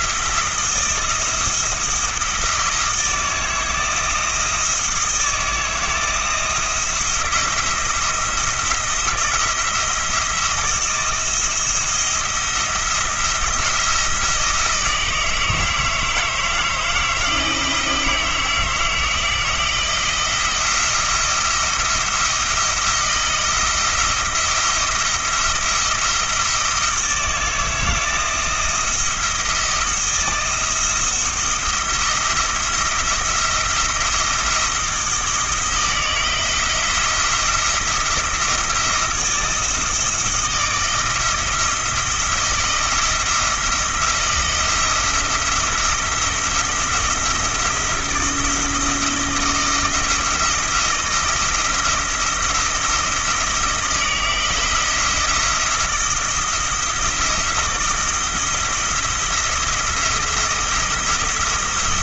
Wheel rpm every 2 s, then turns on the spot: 170, 170, 160, 160, 170, 160, 170, 160, 160, 160, 170, 170, 170, 160, 170, 170, 160, 160, 170, 160, 170, 170, 170, 170, 170, 160, 160, 160, 170, 170, 170.
none